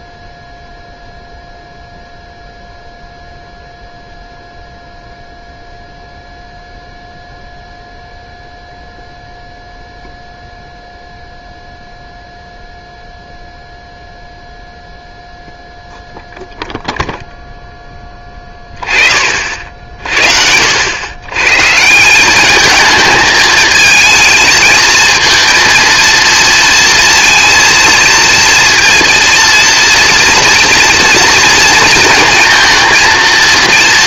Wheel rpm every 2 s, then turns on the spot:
0, 0, 0, 0, 0, 0, 0, 0, 0, 20, 80, 220, 220, 230, 230, 230, 230.
none